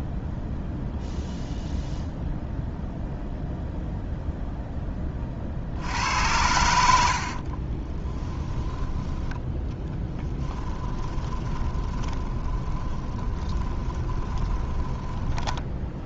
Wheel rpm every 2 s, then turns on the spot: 0, 0, 10, 90, 10, 10, 20, 10.
6-8 10-16